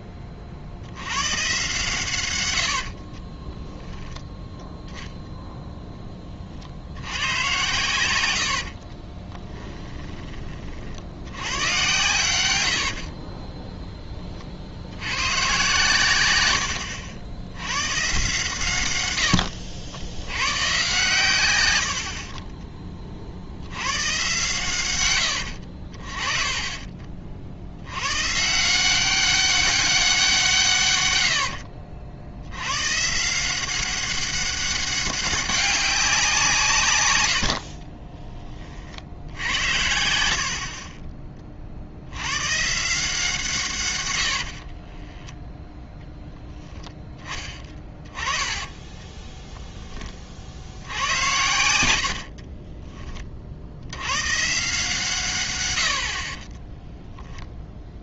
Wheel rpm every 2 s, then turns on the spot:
60, 70, 0, 60, 60, 40, 80, 70, 90, 130, 120, 30, 120, 40, 160, 150, 120, 190, 150, 40, 40, 150, 40, 10, 10, 60, 20, 140, 10.
2-4 8-10 12-14 16-18 44-46 48-50 52-54 56-58